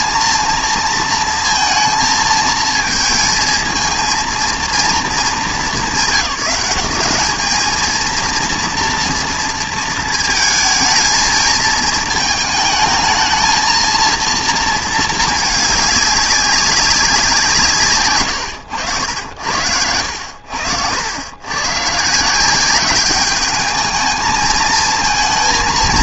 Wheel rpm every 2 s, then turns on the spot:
230, 220, 230, 190, 230, 230, 220, 230, 190, 110, 90, 190, 220.
none